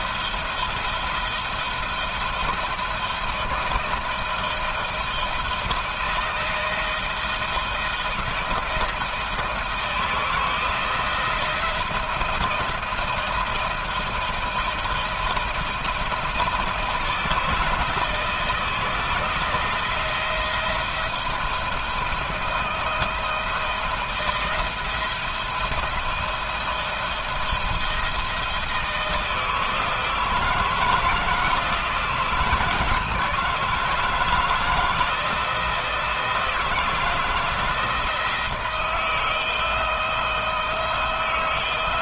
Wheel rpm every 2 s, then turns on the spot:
170, 170, 170, 160, 160, 170, 170, 170, 170, 160, 170, 160, 160, 170, 160, 160, 160, 160, 160, 160, 160.
none